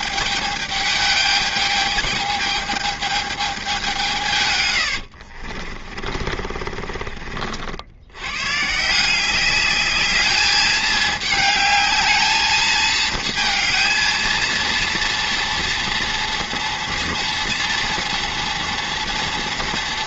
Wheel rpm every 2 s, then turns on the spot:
210, 210, 110, 40, 150, 210, 220, 230, 230, 240.
4-8